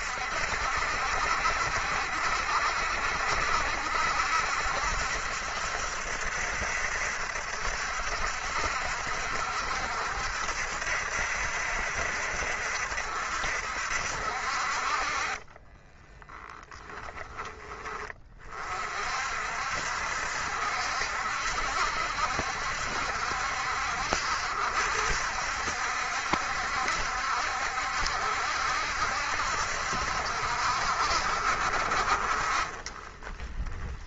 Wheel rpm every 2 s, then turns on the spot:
70, 70, 70, 70, 60, 70, 70, 40, 10, 40, 70, 70, 70, 70, 70, 70, 40.
none